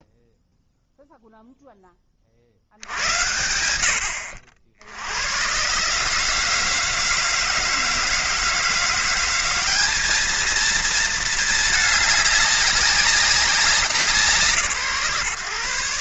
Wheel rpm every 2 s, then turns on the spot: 0, 60, 70, 150, 160, 220, 200, 160.
none